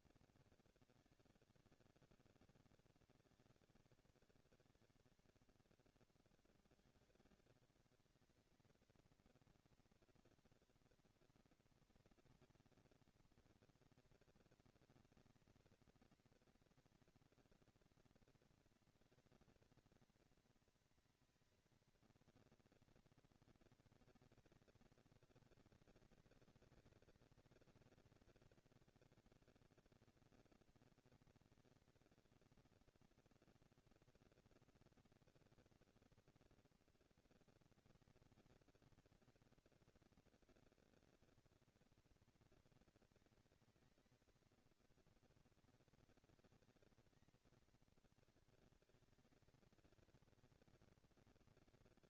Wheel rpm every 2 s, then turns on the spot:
200, 200, 200, 190, 220, 230, 230, 220, 230, 230, 230, 230, 220, 200, 200, 220, 230, 230, 230, 220, 220, 220, 230, 210, 180, 230.
none